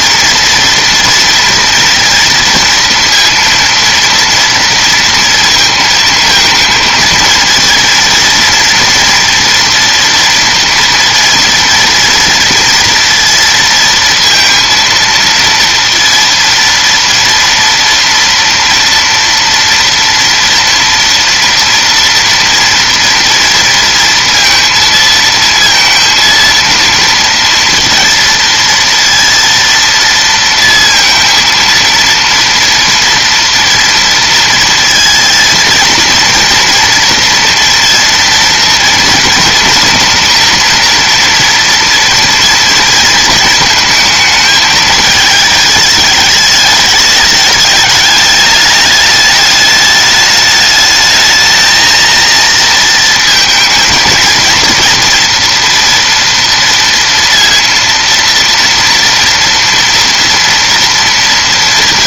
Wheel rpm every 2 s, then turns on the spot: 230, 230, 230, 220, 230, 230, 230, 230, 230, 230, 230, 230, 230, 230, 230, 230, 230, 230, 240, 230, 240, 230, 220, 210, 210, 210, 230, 230, 230, 230, 230.
none